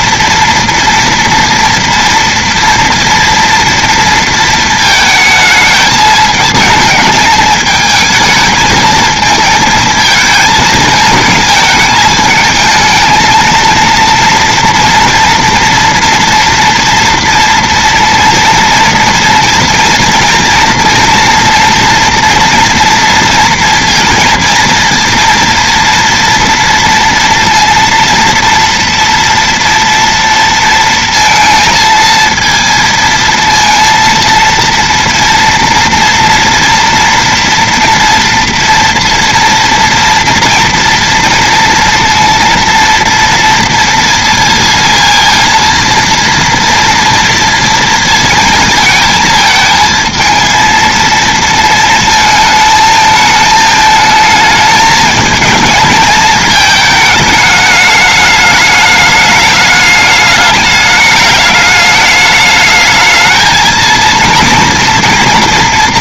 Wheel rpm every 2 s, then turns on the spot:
230, 240, 230, 220, 220, 220, 220, 230, 230, 230, 230, 240, 230, 230, 230, 230, 230, 230, 240, 230, 230, 230, 230, 230, 230, 230, 220, 220, 220, 210, 210, 210, 230.
none